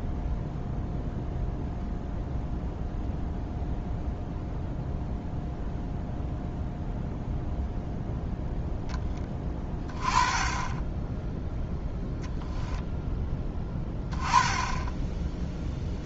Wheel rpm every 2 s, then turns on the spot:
0, 0, 0, 0, 0, 10, 0, 10.
none